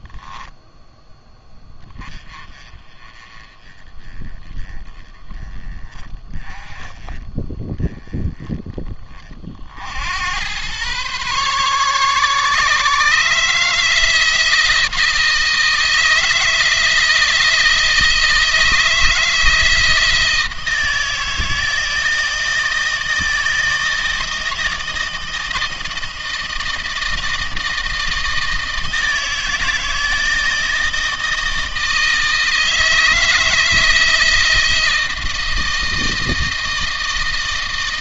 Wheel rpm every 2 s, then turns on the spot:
10, 30, 20, 30, 20, 120, 150, 160, 160, 160, 160, 160, 160, 160, 160, 160, 160, 160, 160.
none